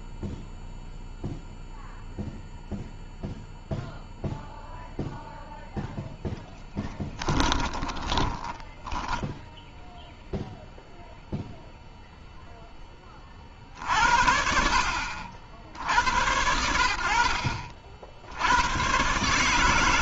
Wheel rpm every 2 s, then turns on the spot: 0, 0, 10, 10, 0, 40, 70, 80, 130, 180.
4-8